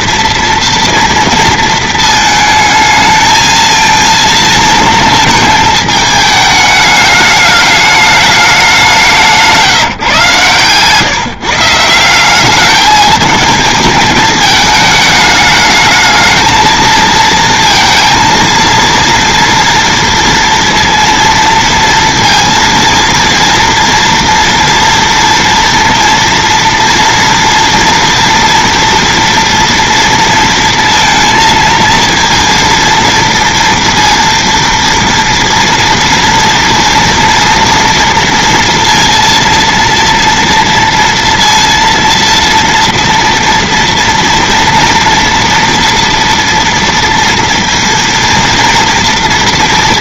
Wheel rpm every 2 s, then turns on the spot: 230, 220, 220, 210, 200, 140, 210, 220, 220, 230, 230, 230, 230, 230, 230, 230, 230, 230, 230, 230, 230, 230, 230, 230, 230.
none